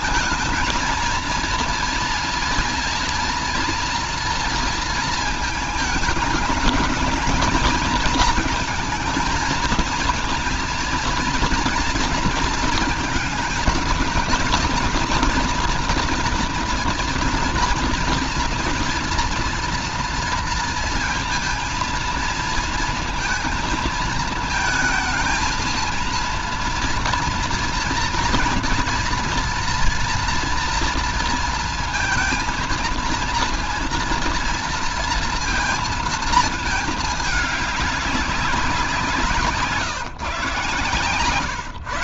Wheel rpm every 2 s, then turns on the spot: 230, 230, 230, 220, 220, 230, 230, 230, 240, 240, 230, 230, 220, 230, 230, 230, 230, 230, 220, 190, 130.
none